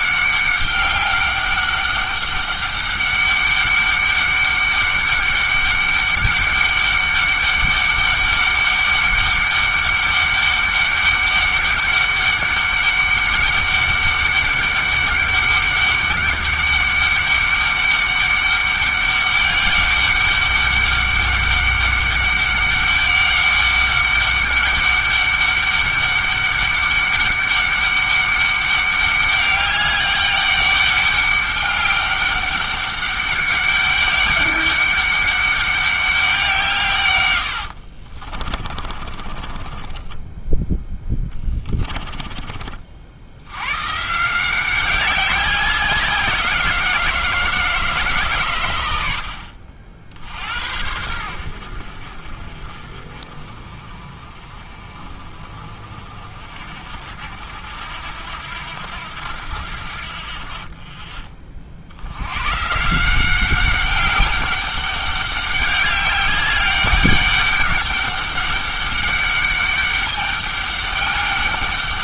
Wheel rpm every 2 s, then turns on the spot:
200, 200, 200, 200, 200, 200, 200, 200, 200, 200, 200, 200, 200, 200, 200, 200, 200, 200, 160, 40, 10, 40, 190, 170, 110, 70, 40, 40, 60, 80, 40, 140, 190, 190, 200, 200.
38-40